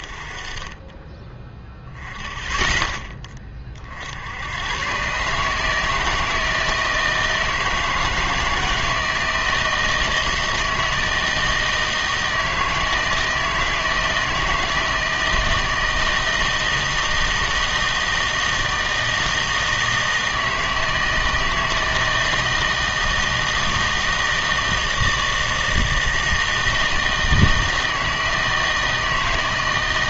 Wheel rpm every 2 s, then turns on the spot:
30, 10, 100, 160, 160, 160, 160, 160, 160, 160, 160, 160, 160, 160, 160.
none